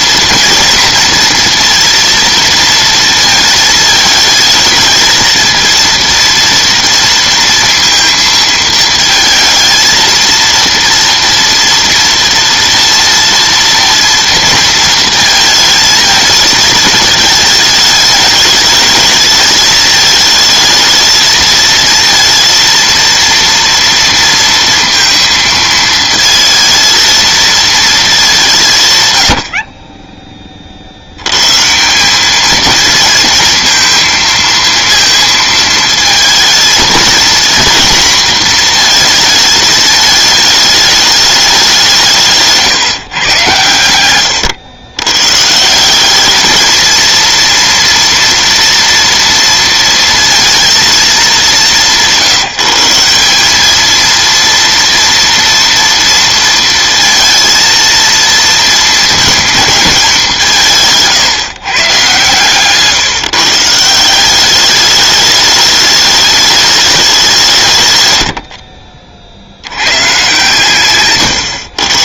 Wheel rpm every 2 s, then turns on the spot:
230, 230, 220, 230, 220, 230, 230, 230, 220, 210, 220, 230, 230, 220, 150, 50, 220, 230, 220, 230, 210, 150, 100, 220, 230, 230, 160, 230, 230, 230, 170, 140, 200, 210, 60, 130.
none